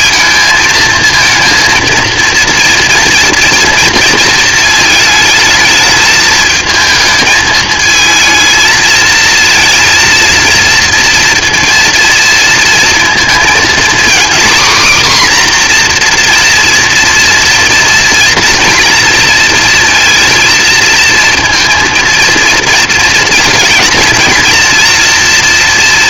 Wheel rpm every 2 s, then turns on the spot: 230, 230, 230, 220, 230, 230, 230, 250, 240, 240, 230, 230, 230.
none